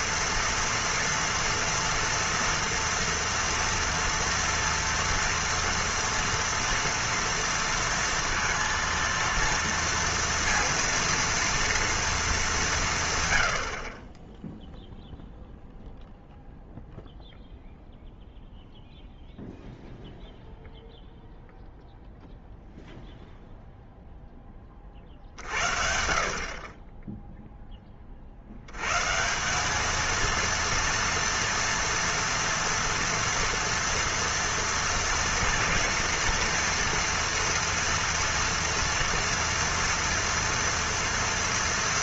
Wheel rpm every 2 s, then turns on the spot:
230, 230, 230, 230, 230, 230, 190, 0, 0, 0, 0, 0, 20, 30, 90, 230, 230, 230, 230, 230, 230.
none